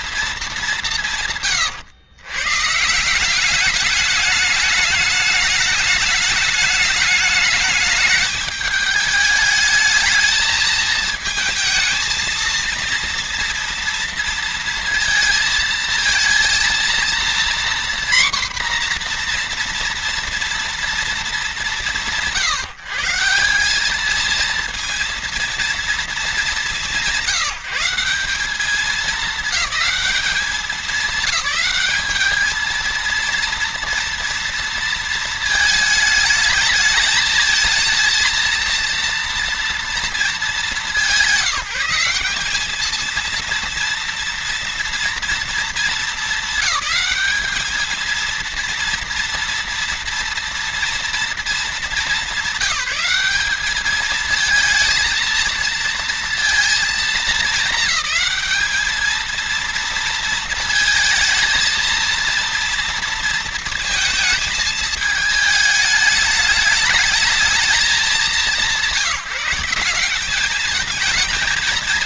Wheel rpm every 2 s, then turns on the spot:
170, 170, 210, 210, 210, 220, 230, 230, 240, 240, 220, 170, 230, 160, 200, 190, 230, 230, 220, 230, 210, 220, 230, 220, 230, 230, 210, 220, 220, 220, 220, 230, 220, 210, 180, 220.
none